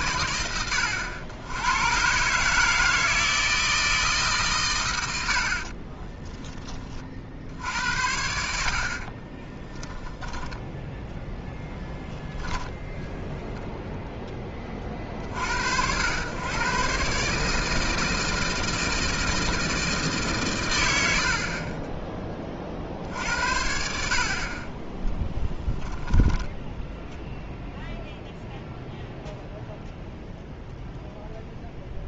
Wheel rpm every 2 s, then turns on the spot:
80, 150, 160, 10, 70, 10, 10, 20, 110, 160, 110, 50, 30, 0, 0, 0.
10-14